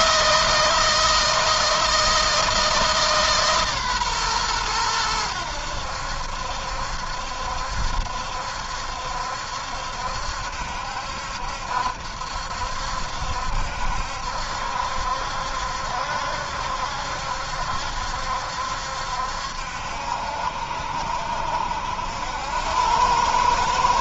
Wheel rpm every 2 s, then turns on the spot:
160, 160, 100, 70, 70, 70, 70, 70, 70, 70, 60, 100.
none